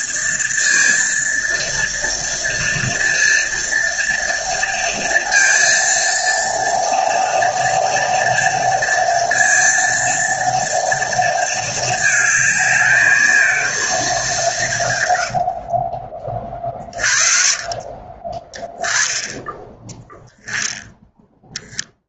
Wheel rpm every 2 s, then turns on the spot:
230, 230, 230, 230, 230, 230, 220, 150, 30, 10, 10.
16-18